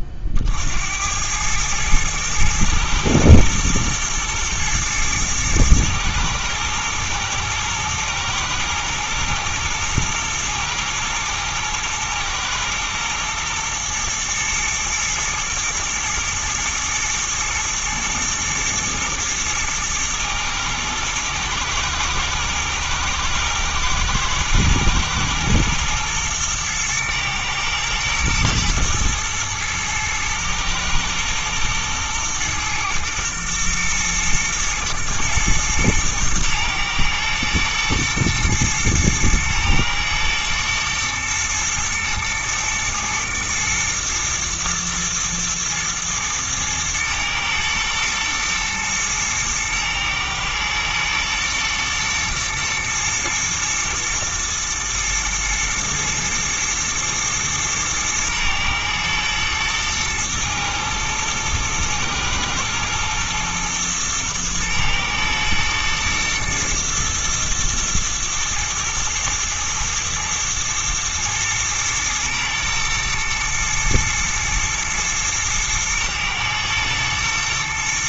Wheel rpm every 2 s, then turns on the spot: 70, 110, 120, 120, 110, 120, 120, 110, 120, 110, 110, 110, 120, 110, 110, 110, 120, 120, 110, 120, 110, 120, 120, 110, 110, 110, 110, 120, 110, 110, 110, 110, 110, 120, 110, 110, 110, 110, 110.
none